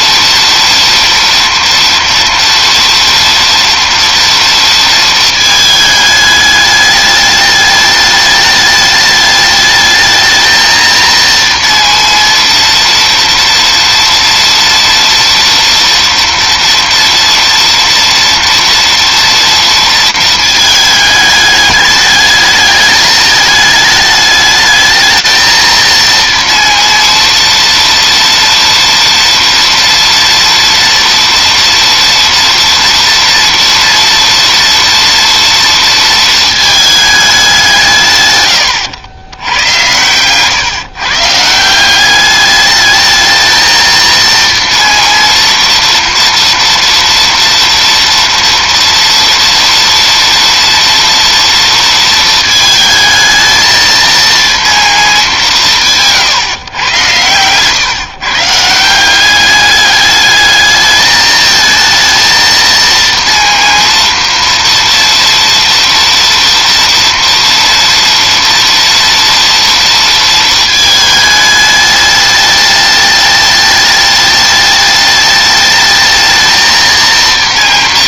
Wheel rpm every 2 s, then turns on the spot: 230, 230, 230, 220, 210, 220, 230, 230, 230, 230, 230, 210, 210, 230, 230, 230, 230, 230, 230, 160, 110, 190, 230, 230, 230, 230, 220, 230, 170, 140, 210, 230, 230, 230, 230, 230, 210, 210, 220.
none